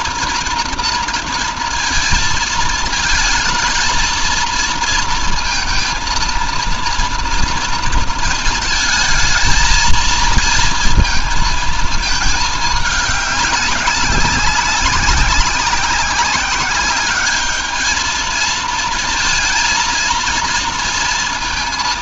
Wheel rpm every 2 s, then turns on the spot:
230, 220, 230, 230, 220, 220, 210, 190, 200, 230, 230.
none